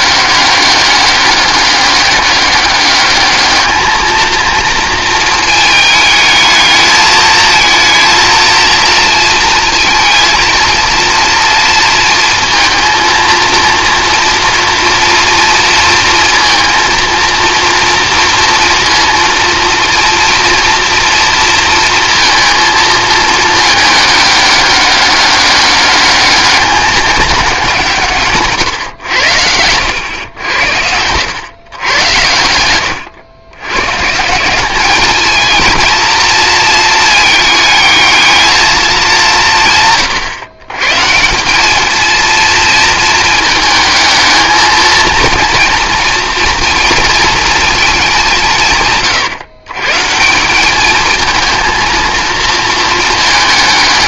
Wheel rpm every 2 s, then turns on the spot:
200, 200, 230, 220, 230, 230, 230, 230, 230, 230, 230, 220, 200, 200, 130, 100, 100, 200, 230, 210, 140, 230, 220, 230, 140, 210, 230.
30-34